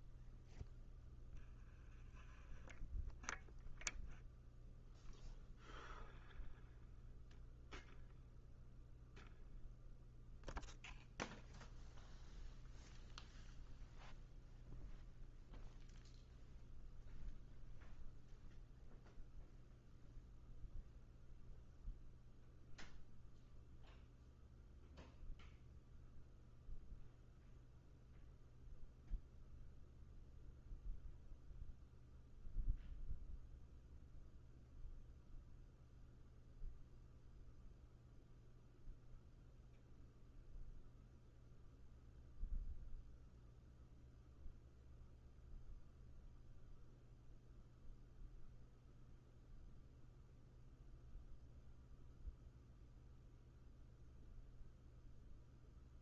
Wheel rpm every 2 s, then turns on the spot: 0, 0, 0, 0, 0, 0, 0, 0, 0, 0, 0, 0, 0, 0, 0, 0, 0, 0, 0, 0, 0, 0, 0, 0, 0, 0, 0, 0.
none